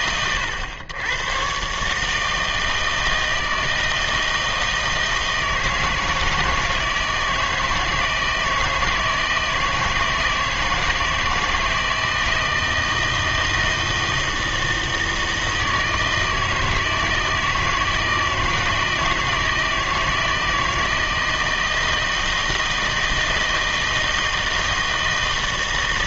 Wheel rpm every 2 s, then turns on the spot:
110, 160, 160, 160, 160, 160, 160, 160, 160, 160, 160, 160, 160.
none